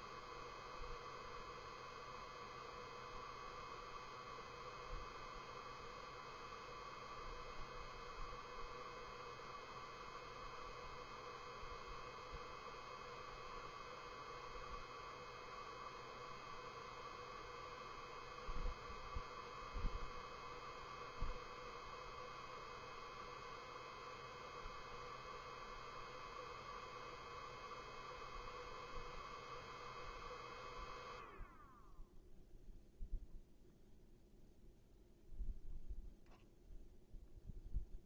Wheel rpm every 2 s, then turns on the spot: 0, 0, 0, 0, 0, 0, 0, 0, 0, 0, 0, 0, 0, 0, 0, 0, 0, 0, 0.
none